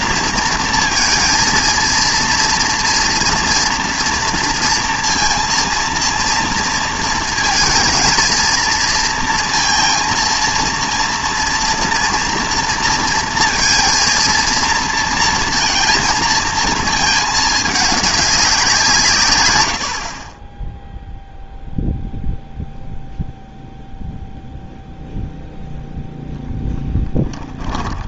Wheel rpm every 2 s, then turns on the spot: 230, 230, 230, 230, 230, 230, 230, 230, 220, 180, 10, 0, 0, 10.
26-28